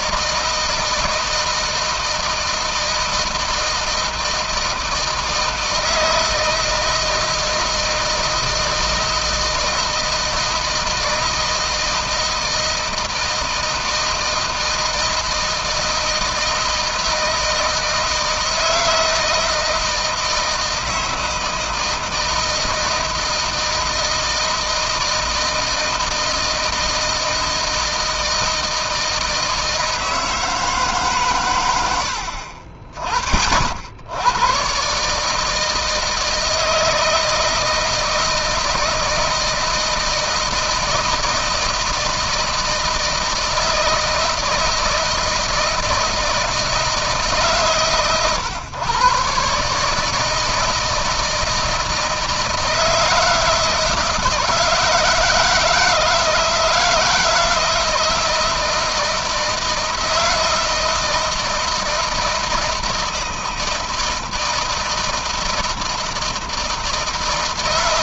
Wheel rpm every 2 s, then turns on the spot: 160, 160, 160, 160, 160, 160, 160, 160, 160, 160, 160, 160, 160, 160, 160, 160, 70, 120, 160, 160, 160, 160, 160, 160, 130, 160, 160, 160, 160, 160, 160, 160, 160, 170.
none